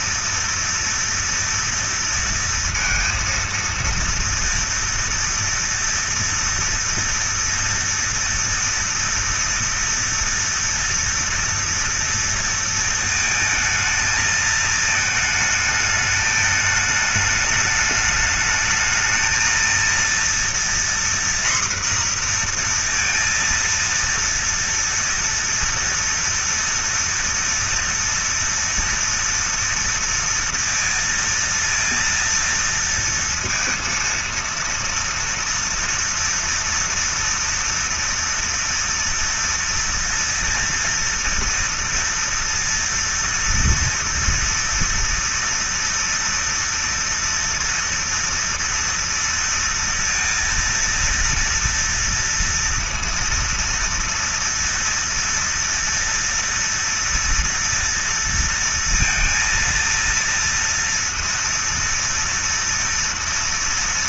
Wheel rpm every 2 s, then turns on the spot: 230, 230, 230, 230, 230, 230, 230, 220, 210, 210, 230, 240, 230, 230, 230, 230, 230, 230, 230, 230, 230, 230, 230, 230, 230, 230, 230, 230, 230, 230, 230, 230.
none